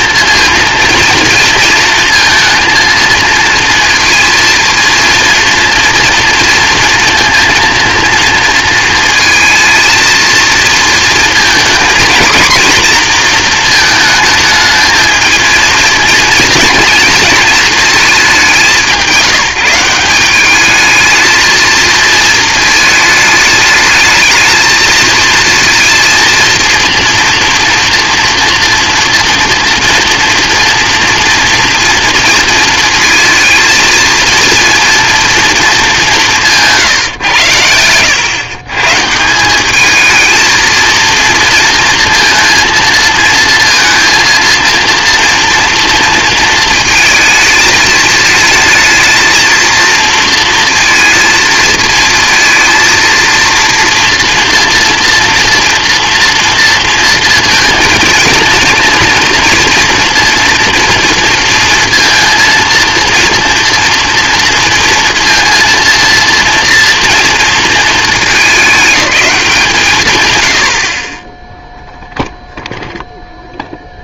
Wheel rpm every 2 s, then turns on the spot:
230, 230, 220, 230, 230, 230, 240, 220, 230, 190, 220, 220, 220, 230, 230, 230, 230, 230, 150, 140, 230, 230, 230, 230, 230, 230, 230, 230, 230, 230, 230, 230, 230, 230, 210, 60, 0.
none